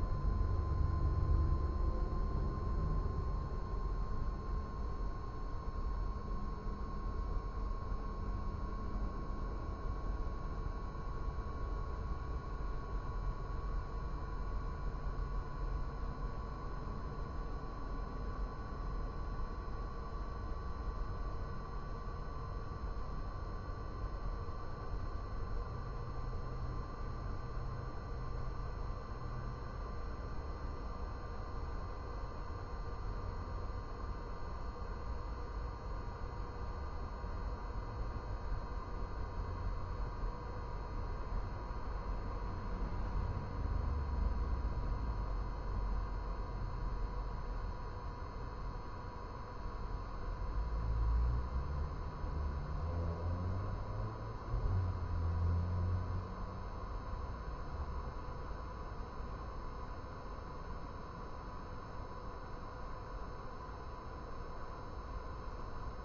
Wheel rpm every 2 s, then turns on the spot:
0, 0, 0, 0, 0, 0, 0, 0, 0, 0, 0, 0, 0, 0, 0, 0, 0, 0, 0, 0, 0, 0, 0, 0, 0, 0, 0, 0, 0, 0, 0, 0, 0.
none